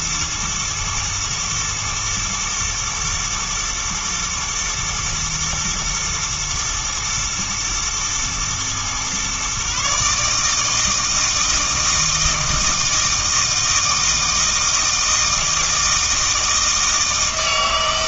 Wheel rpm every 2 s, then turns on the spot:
110, 120, 120, 120, 120, 160, 160, 160, 160.
none